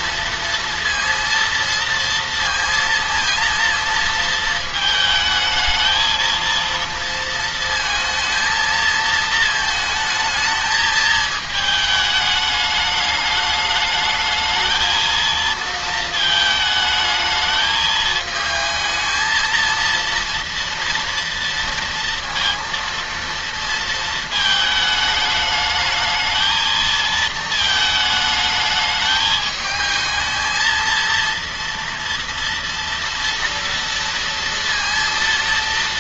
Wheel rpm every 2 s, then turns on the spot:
230, 230, 220, 230, 220, 220, 210, 220, 220, 220, 230, 230, 220, 220, 210, 230, 230, 230.
none